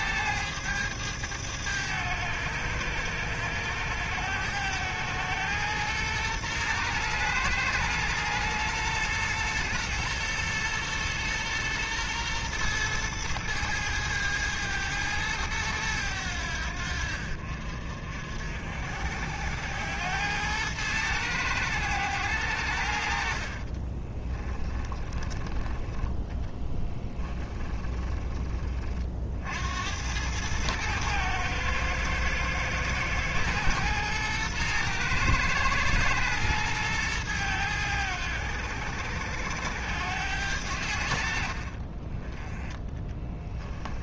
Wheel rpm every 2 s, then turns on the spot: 100, 100, 110, 110, 120, 120, 110, 110, 80, 60, 100, 80, 20, 10, 30, 110, 110, 120, 110, 90, 90, 10.
24-28